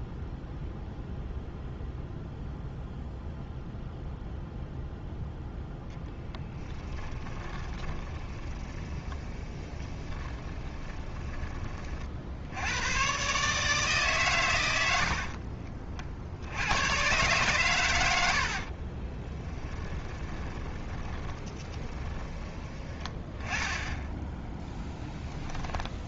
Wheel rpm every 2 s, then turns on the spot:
0, 0, 0, 10, 20, 20, 110, 90, 110, 30, 20, 20, 10.
6-12 18-22